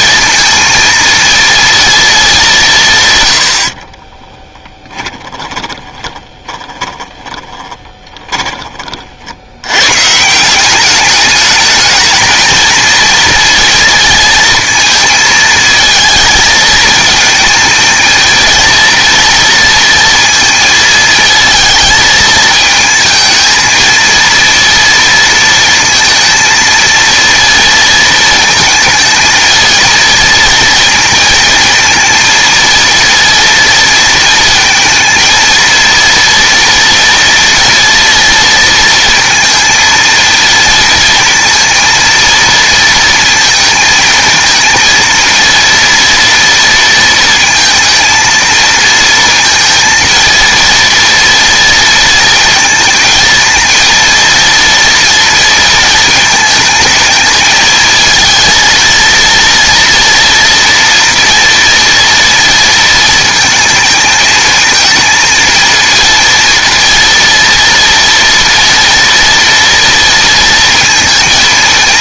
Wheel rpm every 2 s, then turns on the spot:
230, 170, 30, 30, 30, 190, 220, 220, 220, 230, 230, 220, 230, 230, 230, 230, 230, 220, 230, 230, 230, 230, 230, 230, 230, 230, 220, 230, 220, 230, 230, 230, 220, 230, 230, 230.
4-8